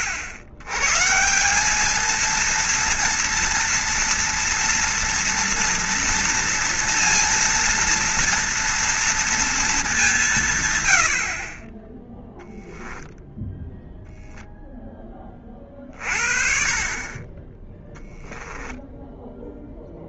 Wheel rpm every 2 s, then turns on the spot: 100, 230, 230, 230, 230, 120, 0, 10, 40, 10.
18-20